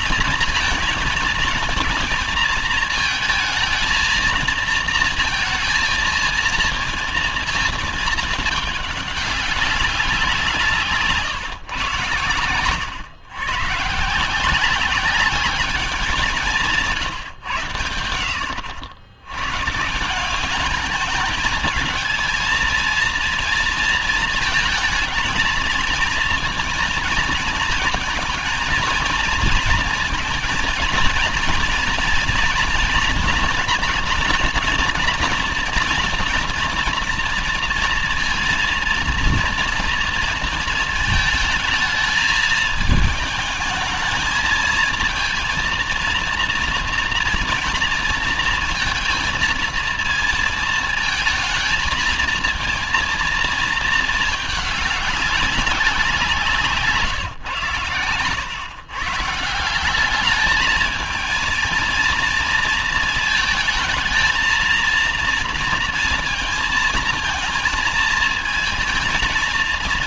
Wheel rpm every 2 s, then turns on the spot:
220, 230, 230, 230, 210, 160, 120, 190, 160, 90, 210, 230, 220, 220, 220, 230, 230, 240, 230, 230, 220, 220, 230, 230, 230, 220, 230, 200, 150, 140, 220, 220, 230, 230, 220.
none